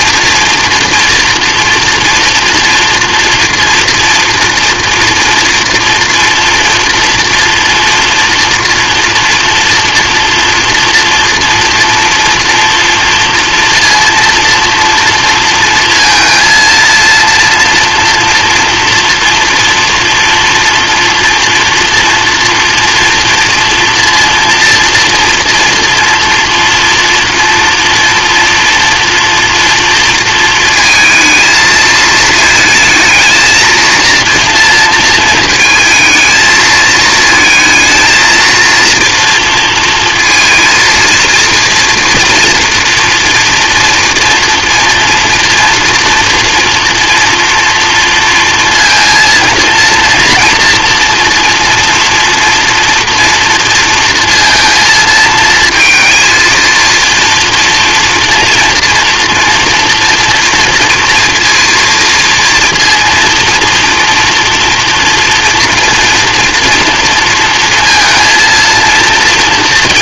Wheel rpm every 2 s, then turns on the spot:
230, 240, 230, 230, 230, 230, 230, 230, 230, 230, 230, 230, 230, 230, 240, 220, 220, 220, 220, 230, 230, 240, 230, 230, 230, 230, 230, 230, 230, 230, 230, 230, 230, 230, 230.
none